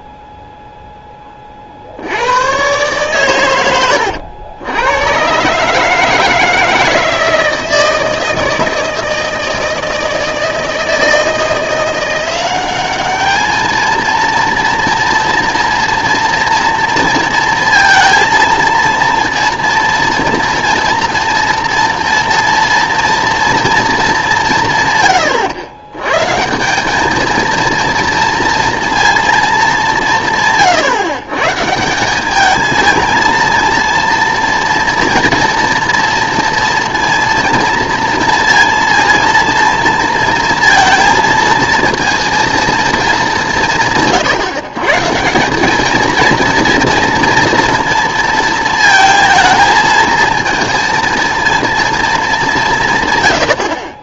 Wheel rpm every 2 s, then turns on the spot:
0, 110, 90, 160, 160, 160, 190, 230, 240, 230, 240, 230, 150, 170, 230, 150, 210, 230, 230, 230, 230, 230, 140, 230, 230, 230, 210.
none